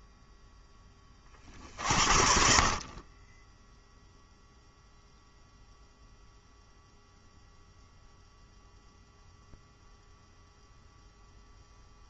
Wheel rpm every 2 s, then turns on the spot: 20, 20, 0, 0, 0, 0.
none